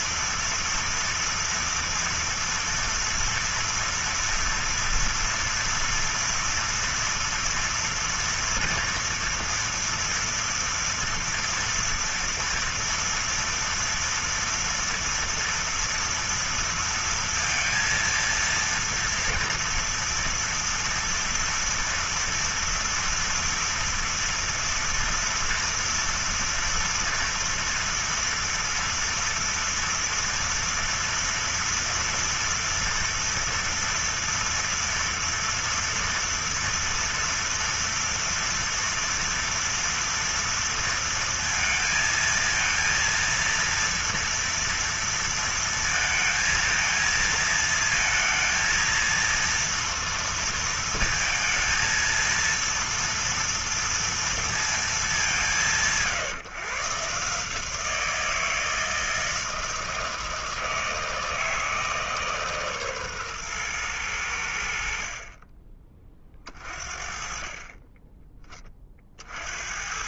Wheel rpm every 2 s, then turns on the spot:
230, 230, 230, 230, 240, 230, 230, 230, 230, 230, 230, 240, 230, 230, 230, 230, 240, 230, 230, 230, 230, 230, 230, 230, 230, 230, 230, 210, 140, 160, 160, 140, 60, 40, 30.
none